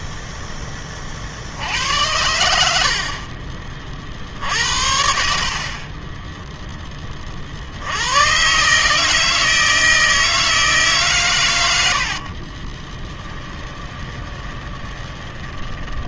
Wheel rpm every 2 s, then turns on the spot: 40, 40, 60, 40, 160, 110, 20, 20.
12-16